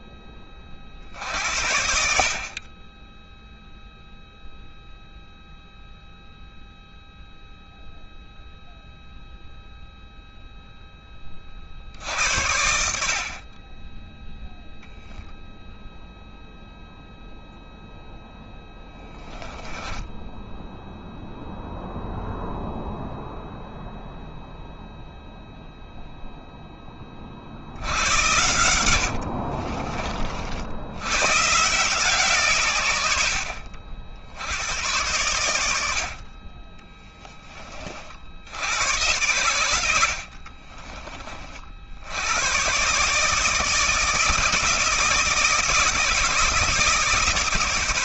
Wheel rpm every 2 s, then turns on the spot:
50, 10, 0, 0, 0, 20, 50, 0, 0, 20, 0, 0, 0, 30, 70, 100, 90, 90, 20, 90, 30, 140, 160, 150.
18-20 28-30